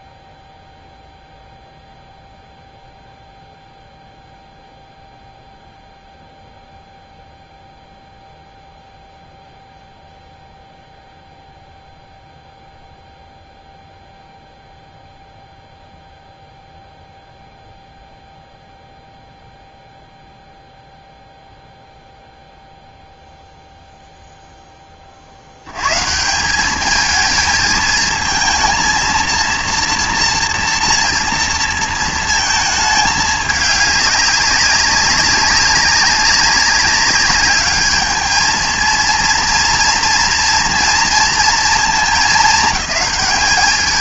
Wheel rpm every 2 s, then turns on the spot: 0, 0, 0, 0, 0, 0, 0, 0, 0, 0, 0, 0, 10, 190, 230, 240, 220, 200, 200, 230, 230, 210.
none